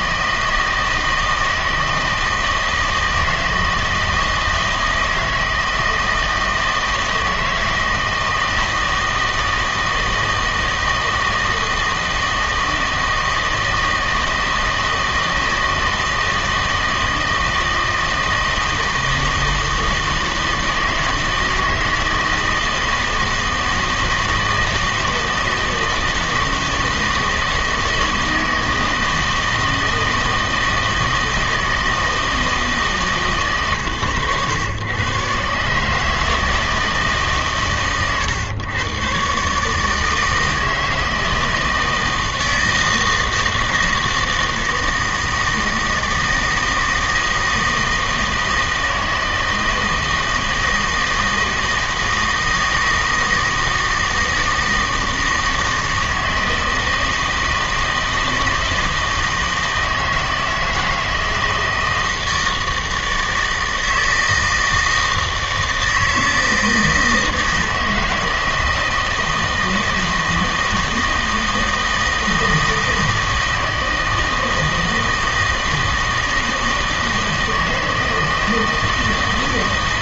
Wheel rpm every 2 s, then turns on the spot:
160, 160, 160, 160, 160, 160, 160, 160, 160, 160, 160, 160, 160, 160, 160, 160, 160, 110, 160, 120, 160, 160, 160, 160, 160, 160, 160, 160, 160, 160, 160, 160, 160, 160, 160, 160, 160, 160, 160, 160.
none